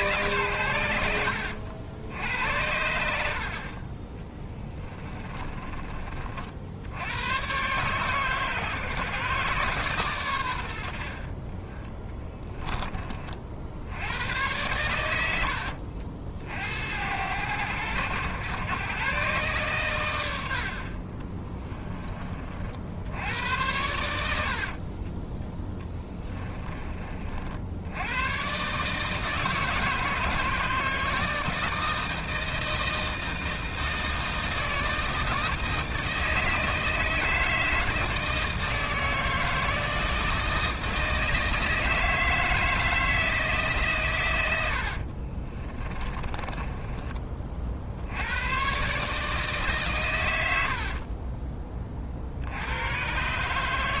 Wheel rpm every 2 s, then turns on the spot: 90, 80, 40, 80, 140, 80, 20, 90, 80, 120, 60, 60, 50, 30, 140, 160, 160, 160, 160, 160, 160, 160, 70, 20, 130, 60, 100.
4-6 24-26 44-48 50-52